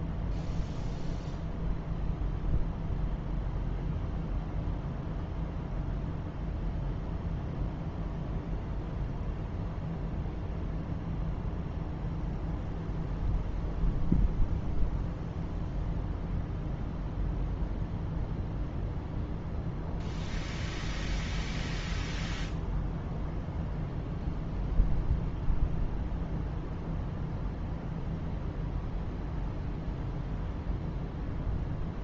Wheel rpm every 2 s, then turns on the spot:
0, 0, 0, 0, 0, 0, 0, 0, 0, 0, 0, 0, 0, 0, 0, 0.
none